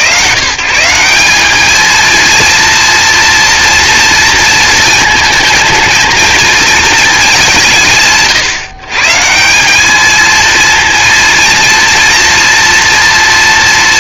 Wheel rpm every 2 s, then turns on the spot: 180, 230, 230, 230, 140, 230, 230.
none